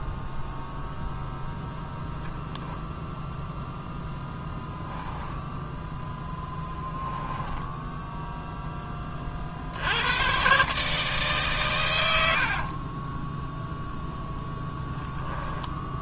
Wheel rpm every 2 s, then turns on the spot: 0, 0, 0, 10, 10, 140, 40, 0.
6-8 12-14